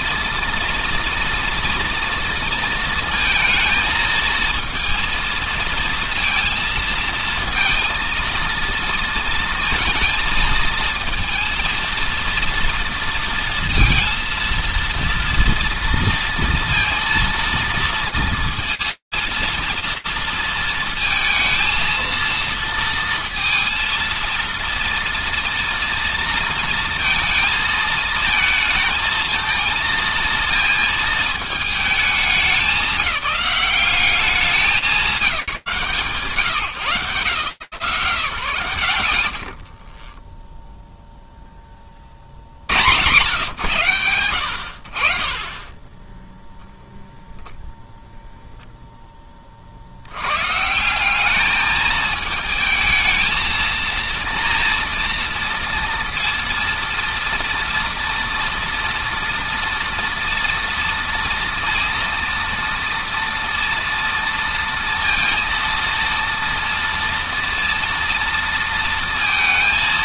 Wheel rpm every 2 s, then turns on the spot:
230, 230, 230, 230, 230, 230, 230, 230, 230, 230, 220, 230, 230, 230, 220, 230, 200, 190, 170, 70, 0, 90, 50, 0, 10, 200, 220, 240, 230, 230, 230, 230, 230, 230, 230.
none